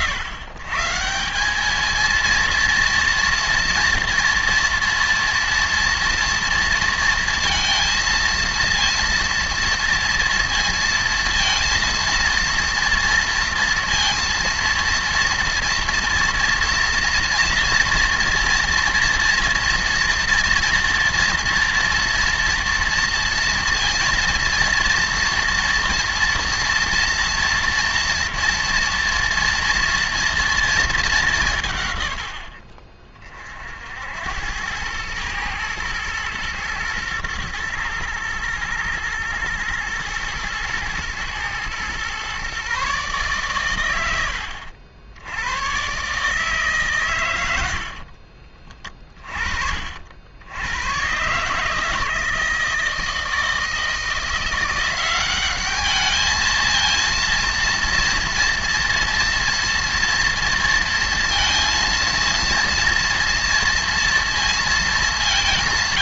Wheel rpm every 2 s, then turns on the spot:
130, 230, 230, 230, 230, 230, 230, 230, 230, 230, 240, 230, 230, 230, 230, 220, 60, 100, 110, 110, 120, 140, 80, 150, 30, 110, 160, 180, 220, 230, 230, 230, 200.
none